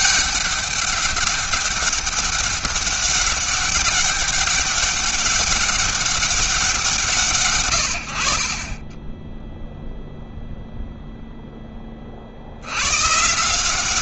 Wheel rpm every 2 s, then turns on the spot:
200, 200, 200, 180, 30, 0, 90.
none